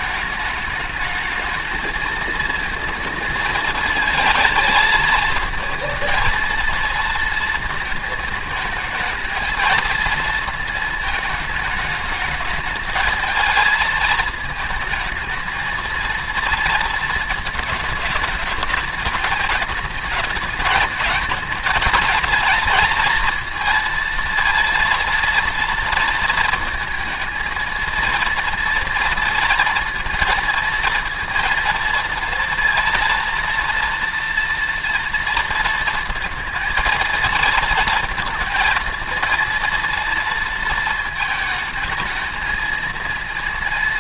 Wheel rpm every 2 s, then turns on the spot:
210, 230, 220, 230, 220, 220, 210, 220, 230, 210, 210, 230, 230, 230, 230, 230, 230, 230, 230, 230, 230, 220.
none